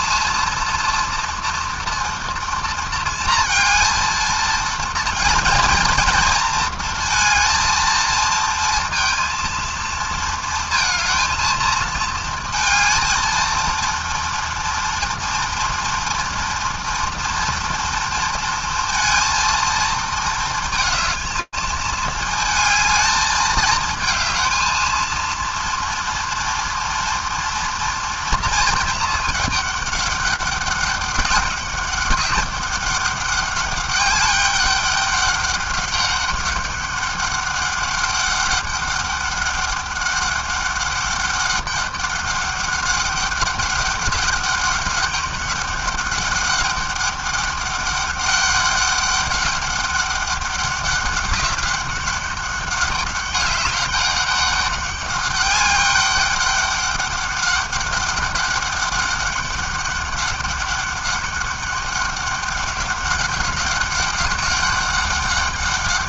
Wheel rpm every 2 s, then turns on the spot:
230, 230, 230, 230, 230, 230, 220, 230, 230, 230, 220, 220, 230, 240, 230, 200, 200, 200, 200, 200, 200, 200, 200, 200, 200, 200, 200, 200, 200, 200, 200, 200, 200.
none